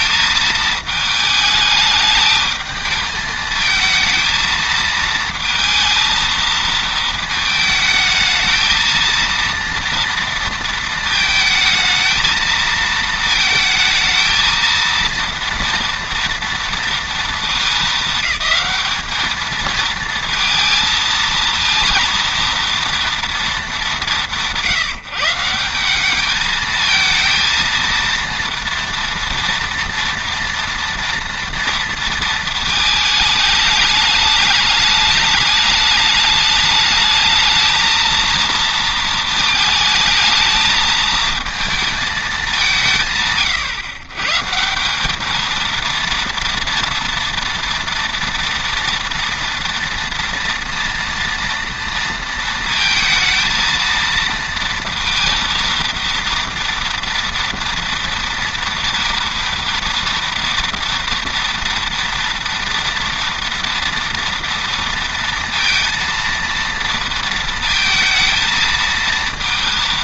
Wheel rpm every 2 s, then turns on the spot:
220, 220, 220, 220, 220, 230, 220, 230, 230, 210, 220, 230, 170, 220, 230, 230, 220, 210, 210, 230, 220, 190, 160, 230, 230, 230, 230, 230, 230, 230, 230, 230, 230, 230, 220.
none